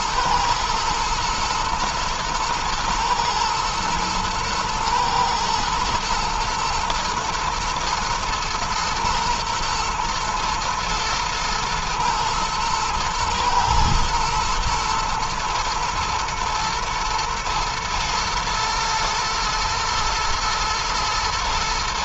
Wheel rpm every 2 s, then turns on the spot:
120, 120, 120, 120, 110, 110, 120, 120, 120, 110, 110.
none